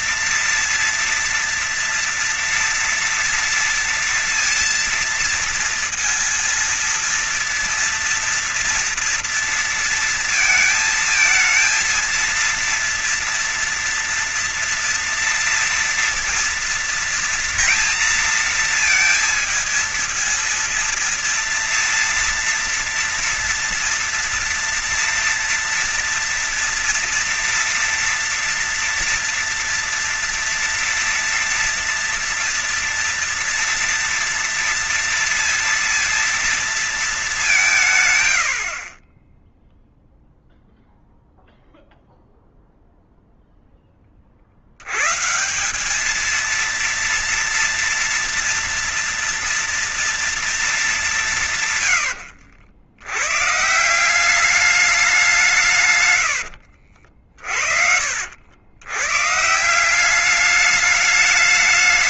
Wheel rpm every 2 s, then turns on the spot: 230, 240, 230, 230, 240, 230, 230, 230, 230, 230, 230, 230, 230, 230, 230, 230, 240, 230, 230, 110, 0, 0, 50, 220, 230, 220, 80, 180, 80, 80, 200.
56-58